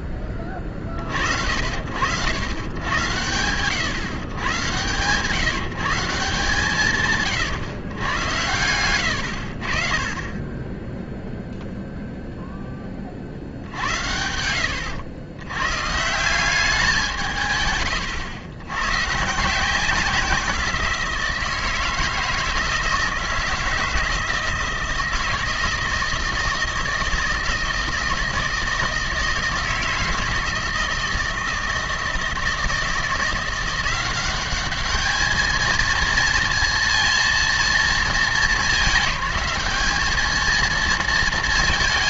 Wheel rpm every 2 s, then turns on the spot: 30, 100, 130, 170, 80, 10, 40, 90, 170, 140, 160, 160, 160, 160, 160, 160, 170, 210, 230, 210, 210.
none